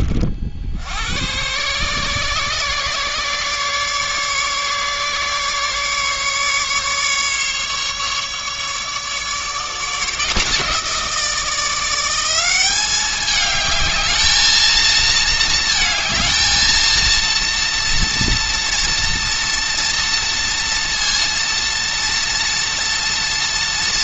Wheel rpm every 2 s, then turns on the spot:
70, 140, 140, 140, 150, 170, 200, 220, 230, 230, 230, 230.
none